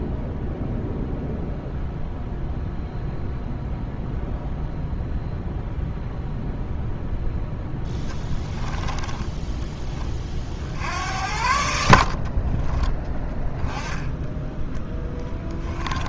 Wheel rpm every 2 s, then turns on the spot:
0, 0, 0, 0, 10, 70, 20, 20.
8-10 12-16